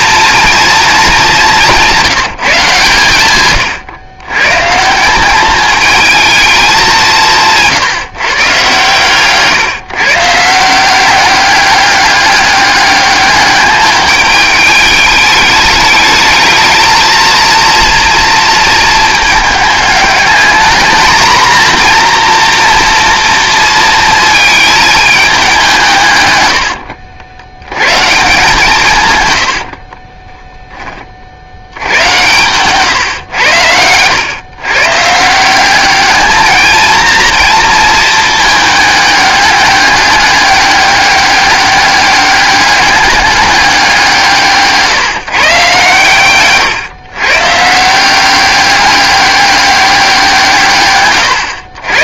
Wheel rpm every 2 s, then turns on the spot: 220, 140, 160, 200, 130, 180, 200, 210, 220, 230, 220, 240, 220, 80, 160, 10, 130, 130, 220, 210, 200, 200, 150, 130, 200, 140.
26-28